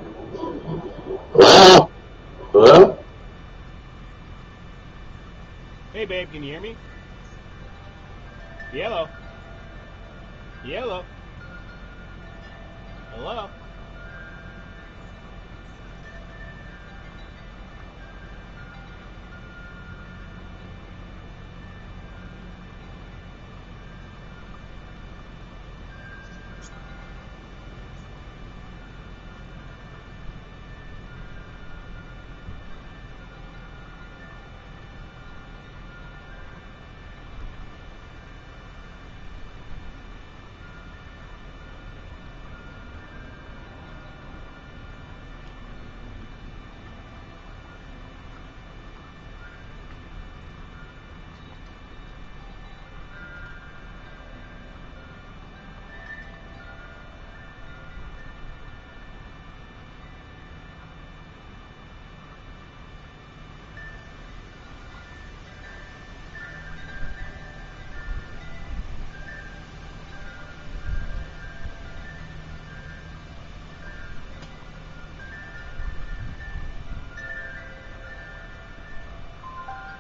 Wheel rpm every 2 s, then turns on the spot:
0, 0, 0, 0, 0, 0, 0, 0, 0, 0, 0, 0, 0, 0, 0, 0, 0, 0, 0, 0, 0, 0, 0, 0, 0, 0, 0, 0, 0, 0, 0, 0, 0, 0, 0, 0, 0, 0, 0, 0.
none